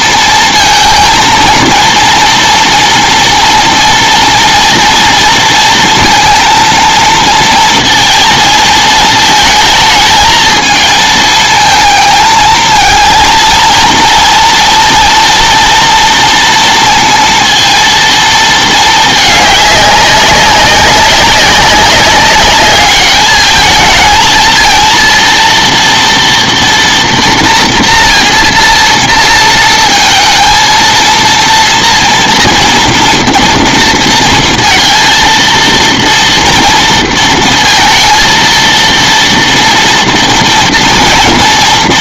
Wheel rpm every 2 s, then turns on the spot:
230, 230, 230, 230, 230, 220, 220, 230, 230, 220, 190, 200, 220, 230, 230, 230, 230, 230, 230, 230, 230.
none